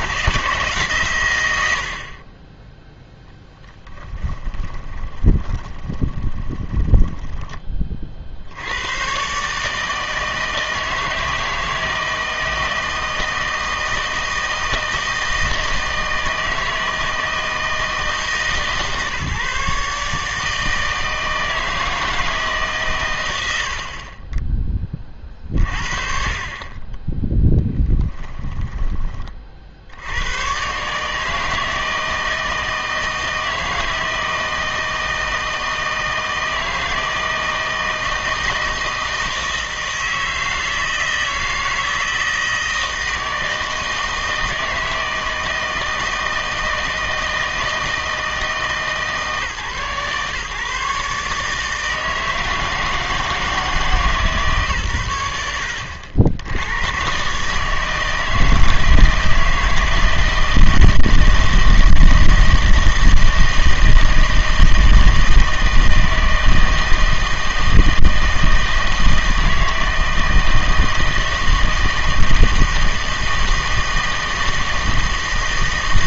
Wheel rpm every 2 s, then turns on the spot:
140, 10, 10, 20, 90, 160, 160, 160, 160, 140, 160, 130, 20, 30, 20, 130, 160, 160, 160, 160, 160, 160, 160, 160, 160, 140, 160, 130, 100, 160, 160, 160, 160, 160, 160, 160, 160, 160.
4-8 28-30